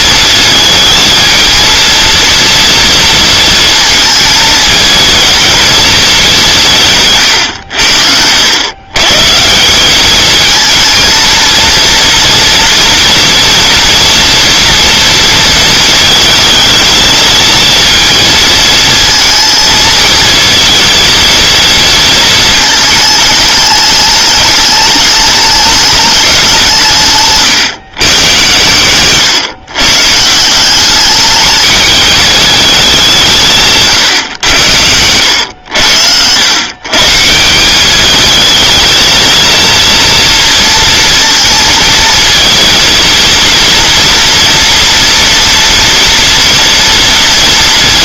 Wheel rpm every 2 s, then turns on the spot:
220, 230, 220, 150, 120, 230, 230, 230, 220, 230, 230, 220, 210, 160, 120, 200, 200, 90, 140, 220, 230, 230, 240, 230.
none